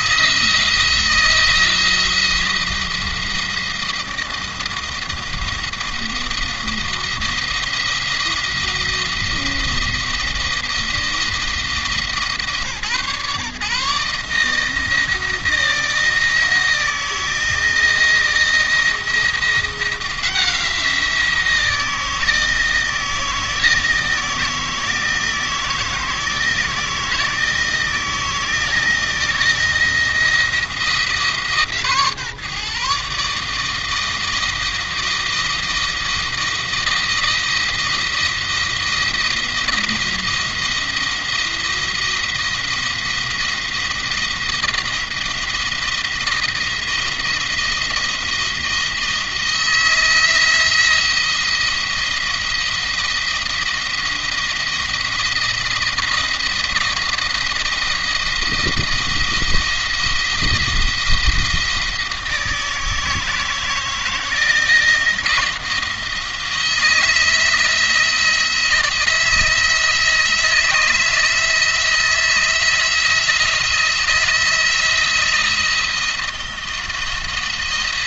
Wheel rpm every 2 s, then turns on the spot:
160, 170, 170, 170, 170, 170, 140, 160, 160, 170, 170, 160, 160, 160, 170, 160, 140, 160, 170, 170, 170, 170, 170, 170, 160, 170, 170, 170, 170, 170, 170, 160, 160, 170, 170, 170, 170, 170, 170.
none